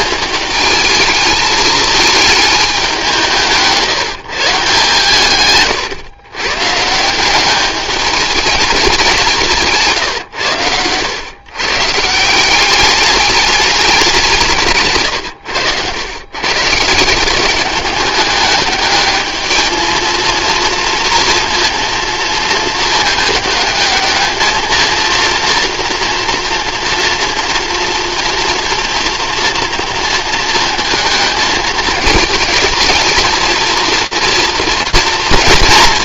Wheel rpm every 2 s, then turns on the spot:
220, 200, 150, 140, 190, 100, 200, 150, 150, 210, 230, 220, 220, 230, 230, 220, 220, 230.
none